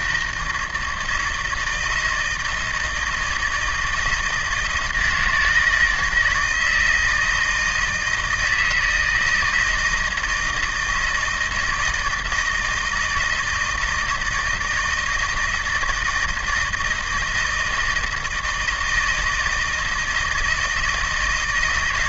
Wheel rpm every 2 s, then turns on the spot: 160, 160, 160, 160, 160, 170, 160, 160, 160, 160, 160.
none